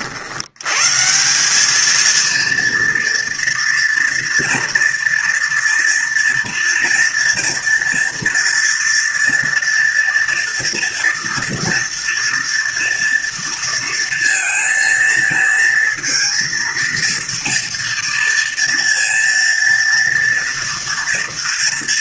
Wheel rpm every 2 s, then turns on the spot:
90, 230, 240, 230, 230, 230, 230, 230, 230, 230, 230.
none